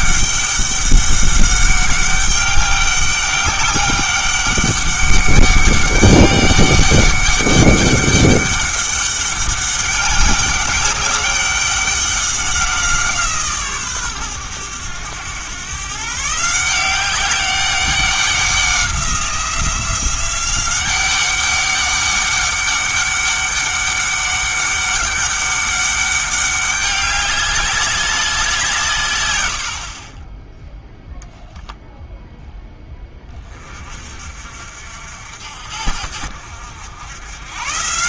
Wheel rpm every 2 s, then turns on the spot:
200, 200, 200, 200, 200, 200, 180, 100, 170, 190, 190, 200, 200, 200, 160, 0, 10, 60, 80.
none